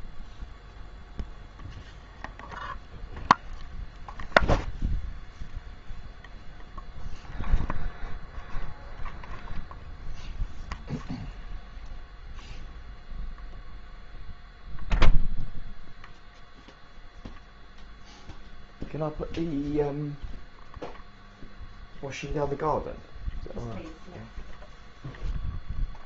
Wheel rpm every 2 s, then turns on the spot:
0, 0, 0, 0, 0, 0, 0, 0, 0, 0, 0, 0, 0.
none